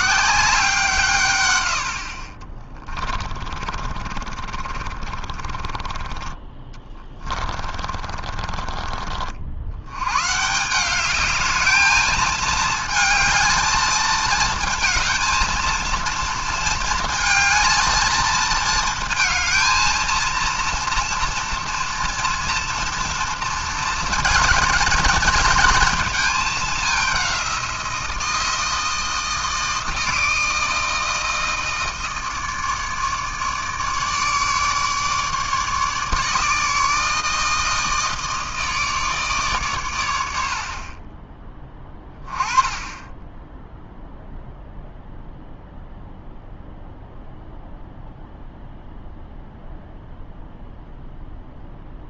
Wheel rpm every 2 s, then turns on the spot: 180, 30, 50, 20, 30, 150, 220, 220, 230, 220, 230, 230, 230, 210, 160, 160, 160, 150, 150, 160, 60, 20, 0, 0, 0, 0.
2-10